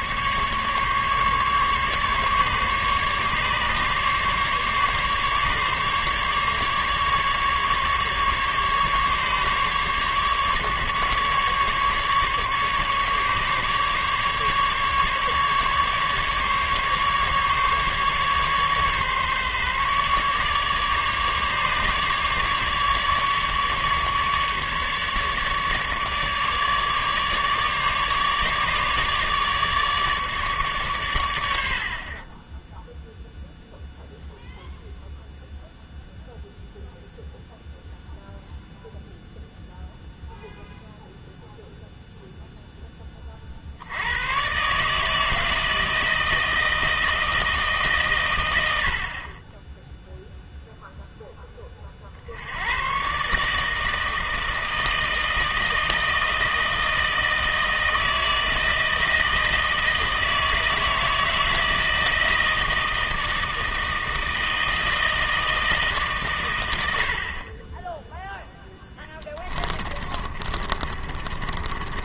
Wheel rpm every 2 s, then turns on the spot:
140, 140, 140, 150, 150, 150, 150, 150, 150, 140, 140, 150, 150, 150, 150, 130, 0, 0, 0, 0, 0, 10, 150, 160, 70, 0, 120, 160, 160, 160, 160, 160, 160, 80, 10, 30.
68-72